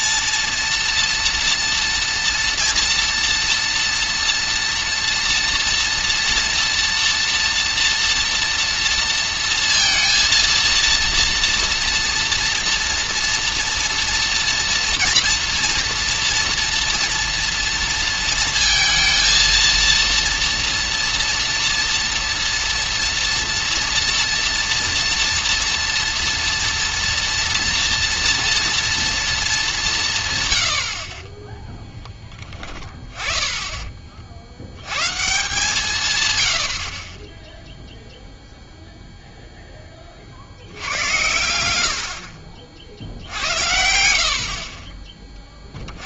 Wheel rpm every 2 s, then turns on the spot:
230, 230, 240, 240, 230, 230, 230, 230, 230, 230, 230, 230, 230, 230, 230, 130, 20, 90, 90, 0, 80, 60, 30.
none